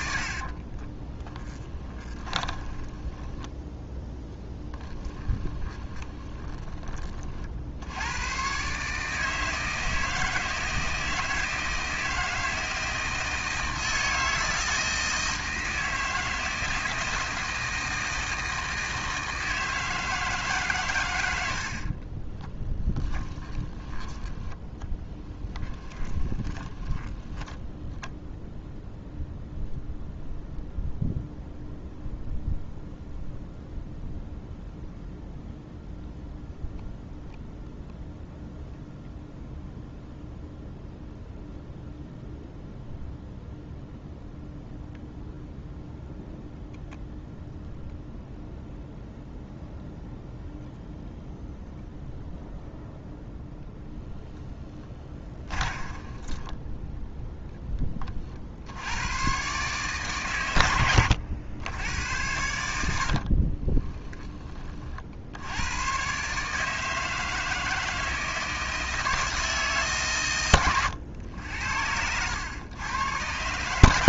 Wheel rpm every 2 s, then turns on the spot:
40, 20, 10, 30, 140, 160, 160, 160, 160, 160, 130, 20, 10, 10, 0, 0, 0, 0, 0, 0, 0, 0, 0, 0, 0, 0, 0, 10, 10, 90, 90, 70, 50, 160, 160, 110, 110.
0-6 22-28 54-56 60-64 70-72